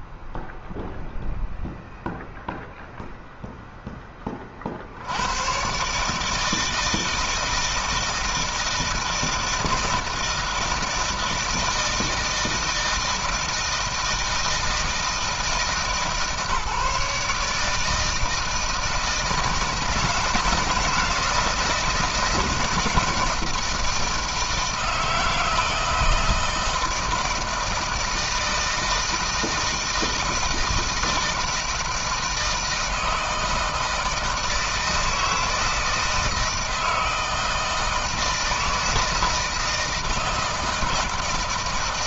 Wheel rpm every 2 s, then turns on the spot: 0, 0, 70, 160, 160, 160, 160, 160, 150, 160, 160, 170, 160, 160, 160, 170, 160, 160, 160, 160, 160.
none